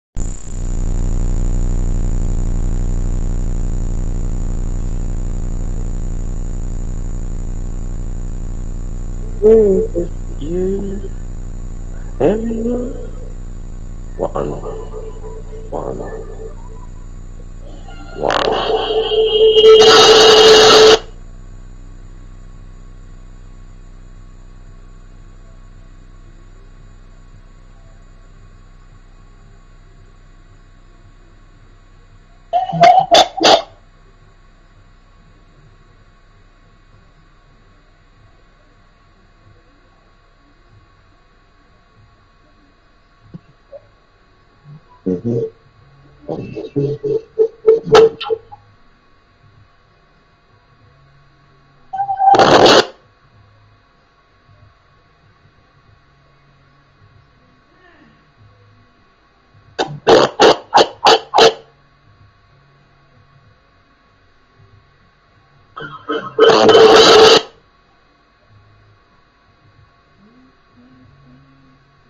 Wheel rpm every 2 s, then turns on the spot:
0, 0, 0, 0, 0, 0, 0, 0, 0, 0, 0, 0, 0, 0, 0, 0, 0, 0, 0, 0, 0, 0, 0, 0, 0, 0, 0, 0, 0, 0, 0, 0, 0, 0, 0, 0.
none